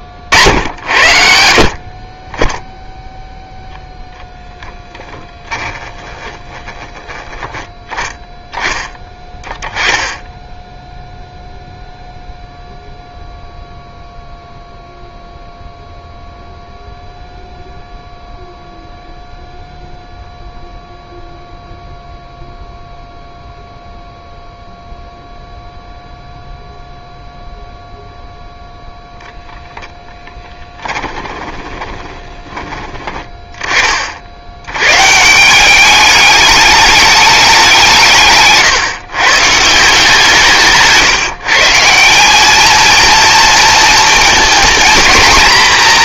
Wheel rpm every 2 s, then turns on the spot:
60, 10, 10, 10, 10, 10, 0, 0, 0, 0, 0, 0, 0, 0, 0, 10, 30, 90, 210, 150, 160, 210, 230.
4-6 30-32